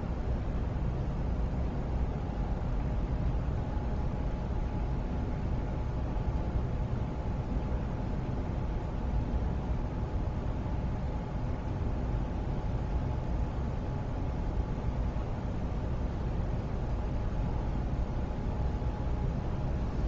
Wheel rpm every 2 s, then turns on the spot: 0, 0, 0, 0, 0, 0, 0, 0, 0, 0.
none